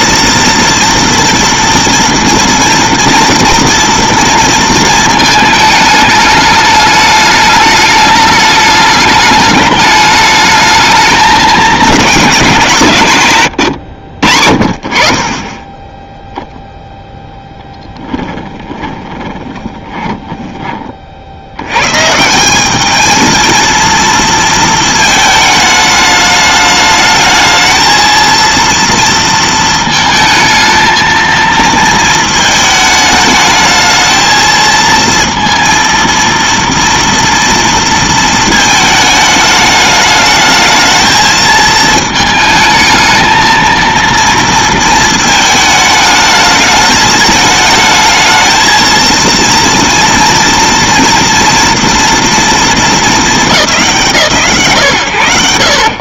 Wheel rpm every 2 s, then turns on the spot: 230, 230, 220, 210, 210, 210, 140, 40, 0, 20, 30, 210, 230, 210, 230, 220, 220, 230, 230, 220, 220, 220, 230, 210, 220, 230, 220, 100.
18-20